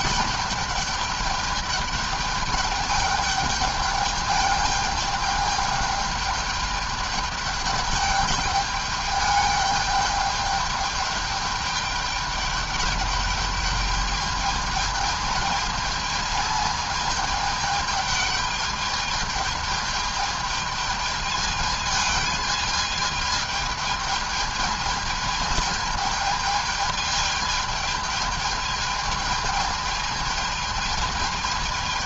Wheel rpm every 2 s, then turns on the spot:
200, 210, 210, 210, 210, 210, 210, 210, 220, 210, 220, 220, 220, 220, 220, 210.
none